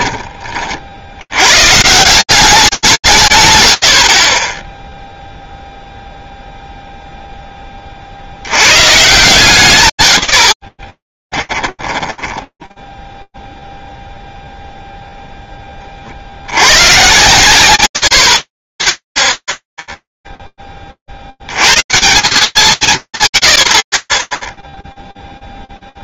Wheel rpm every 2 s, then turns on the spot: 80, 190, 0, 0, 130, 10, 10, 0, 70, 60, 0, 160, 10.
10-14